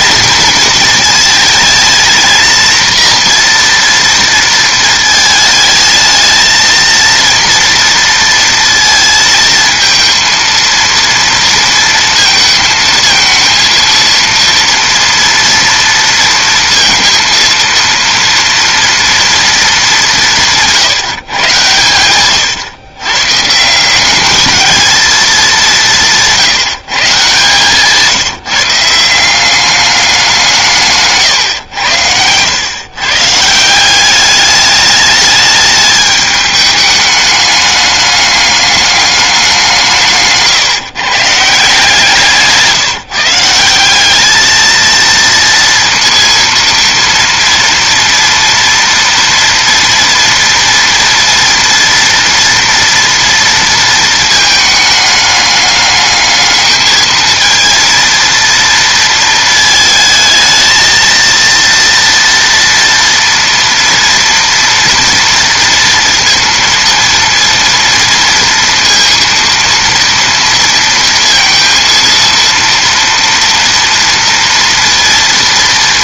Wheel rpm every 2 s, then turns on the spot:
220, 230, 230, 220, 230, 230, 230, 230, 230, 230, 170, 130, 220, 170, 160, 150, 110, 210, 210, 210, 150, 160, 220, 230, 230, 230, 230, 220, 220, 230, 230, 230, 230, 230, 230, 230, 230, 230.
none